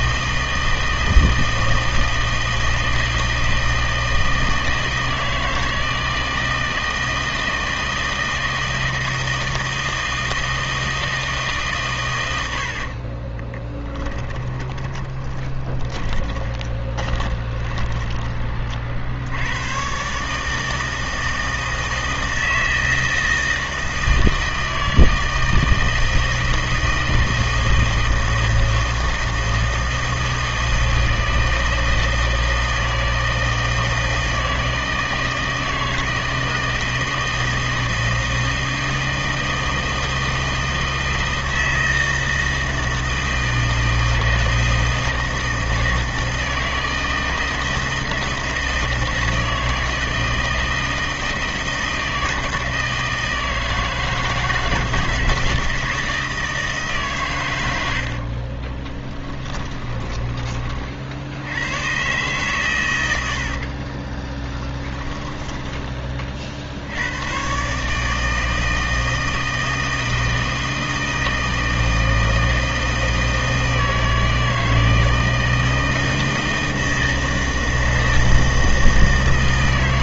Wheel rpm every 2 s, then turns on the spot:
160, 160, 160, 160, 160, 160, 80, 20, 20, 20, 150, 160, 160, 160, 160, 160, 160, 160, 170, 160, 160, 160, 160, 160, 160, 160, 160, 160, 160, 30, 30, 130, 20, 50, 160, 160, 160, 160, 160, 160.
12-18 58-60 64-66